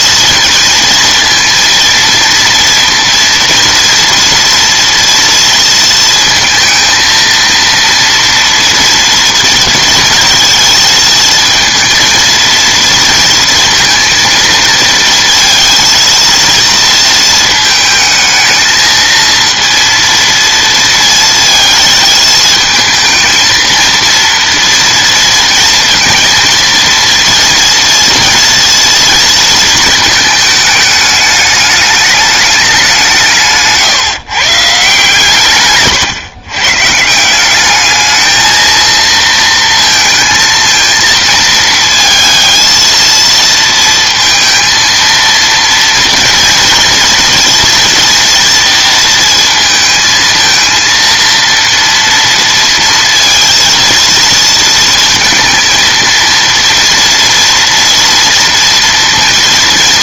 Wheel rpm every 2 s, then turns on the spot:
230, 230, 230, 230, 230, 220, 230, 230, 230, 220, 230, 220, 230, 230, 230, 210, 200, 140, 140, 230, 220, 230, 230, 230, 230, 230, 230, 230, 240, 230.
none